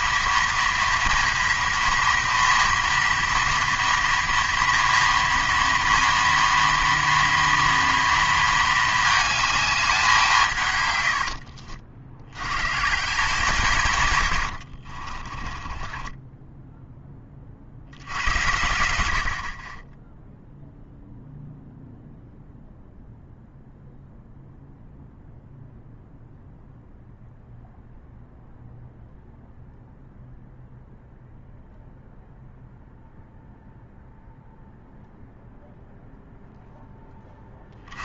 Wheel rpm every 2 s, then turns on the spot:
230, 230, 230, 230, 220, 140, 110, 80, 10, 90, 0, 0, 0, 0, 0, 0, 0, 0, 0.
14-18